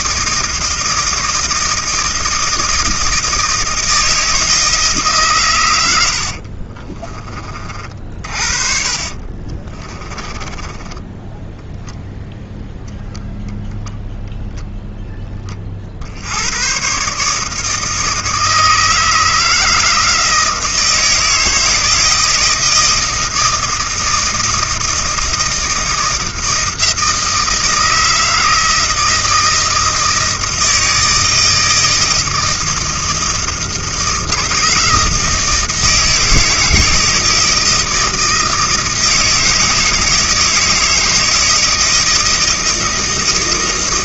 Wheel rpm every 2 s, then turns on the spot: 160, 160, 160, 40, 50, 20, 0, 0, 110, 160, 170, 160, 160, 160, 160, 160, 160, 160, 160, 160, 160, 160.
6-12